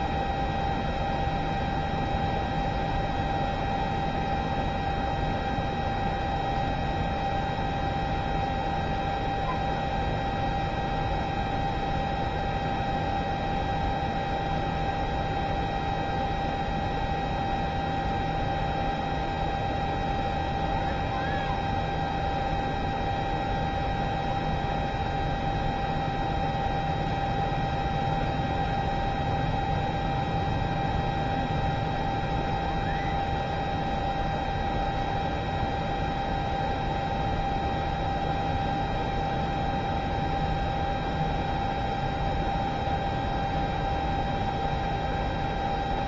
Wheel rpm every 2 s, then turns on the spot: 0, 0, 0, 0, 0, 0, 0, 0, 0, 0, 0, 0, 0, 0, 0, 0, 0, 0, 0, 0, 0, 0, 0.
none